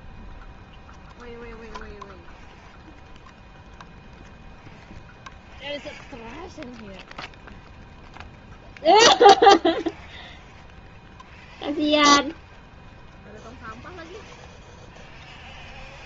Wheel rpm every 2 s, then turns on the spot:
0, 0, 0, 0, 0, 0, 0, 0.
none